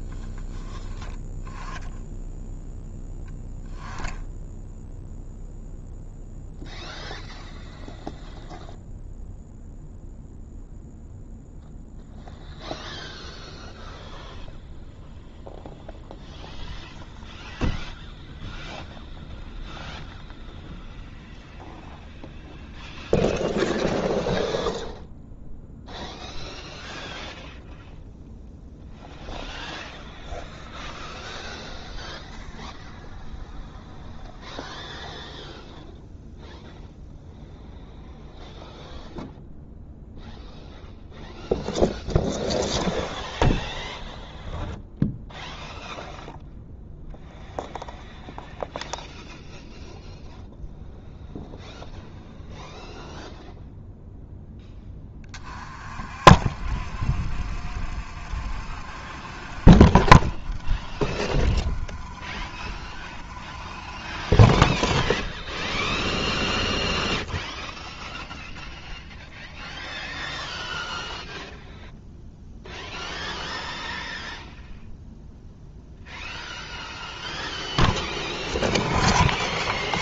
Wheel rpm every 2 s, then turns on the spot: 10, 0, 0, 0, 0, 0, 0, 0, 0, 0, 0, 0, 0, 0, 0, 0, 0, 0, 0, 0, 0, 0, 0, 0, 0, 0, 0, 10, 30, 30, 20, 20, 20, 0, 0, 0, 0, 0, 0, 0.
none